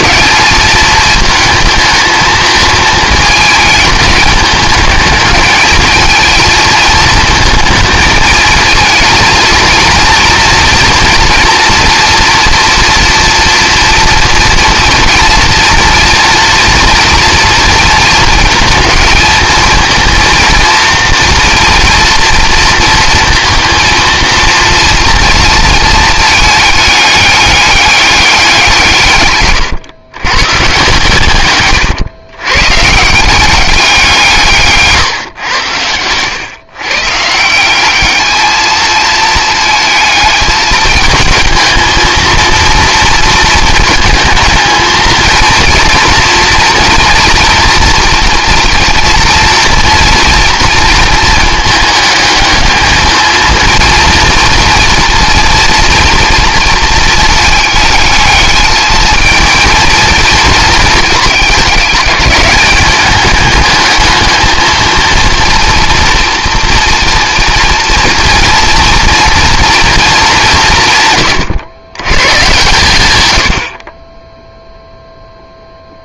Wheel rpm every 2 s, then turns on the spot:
220, 220, 210, 220, 220, 230, 230, 240, 240, 230, 230, 230, 230, 210, 170, 130, 140, 150, 130, 220, 220, 230, 220, 230, 230, 230, 220, 230, 220, 220, 230, 200, 220, 230, 230, 170, 120, 0.
none